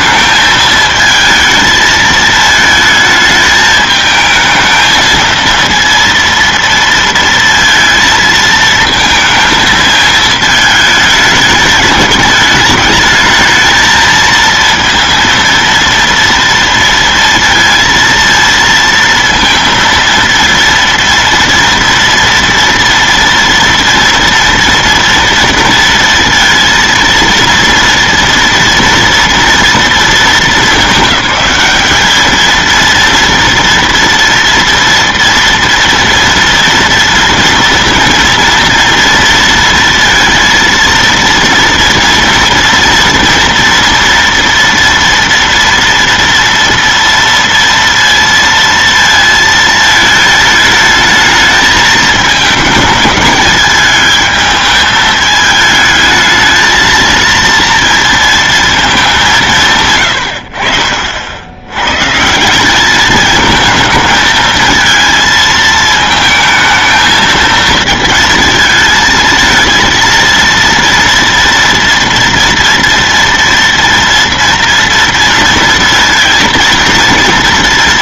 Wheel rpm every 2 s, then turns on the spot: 220, 220, 220, 230, 220, 220, 220, 230, 230, 230, 230, 230, 230, 230, 230, 220, 220, 230, 230, 230, 230, 230, 240, 230, 230, 220, 220, 220, 220, 230, 80, 180, 220, 220, 220, 230, 230, 230, 230.
none